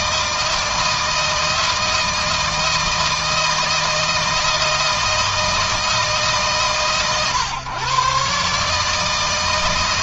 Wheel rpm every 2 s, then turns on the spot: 160, 160, 160, 130, 150.
none